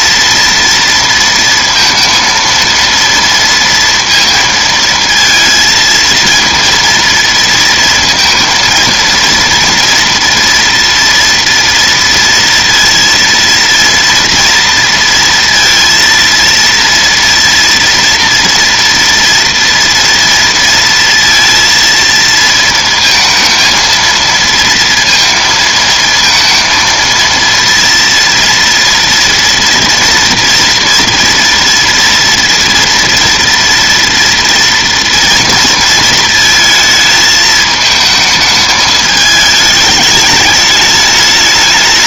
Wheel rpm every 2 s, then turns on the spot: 230, 230, 230, 230, 230, 230, 230, 230, 230, 230, 230, 230, 230, 230, 230, 230, 230, 230, 220, 220, 210.
none